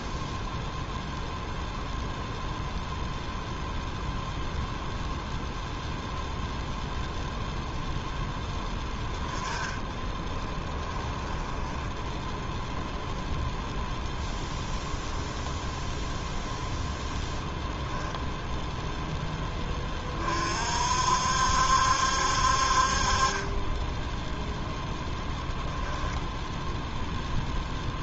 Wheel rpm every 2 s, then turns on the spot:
0, 0, 0, 0, 10, 10, 0, 0, 0, 0, 60, 50, 0, 0.
10-12